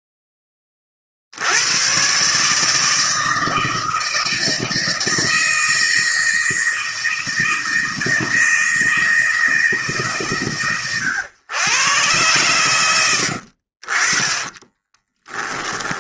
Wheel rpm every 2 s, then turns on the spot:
30, 150, 160, 160, 160, 130, 120, 20.
12-16